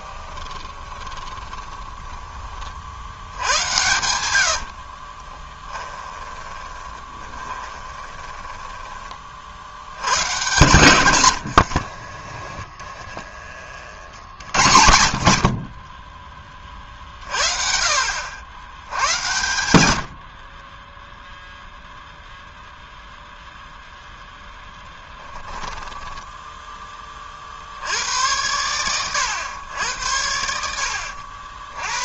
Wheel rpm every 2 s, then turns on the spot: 20, 40, 70, 20, 20, 120, 20, 70, 30, 80, 20, 0, 20, 10, 110, 70.
0-2 4-10 12-14 24-26